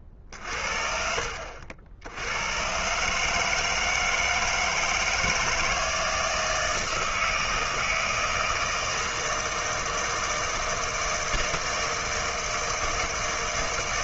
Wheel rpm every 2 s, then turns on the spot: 50, 110, 160, 160, 160, 160, 160.
none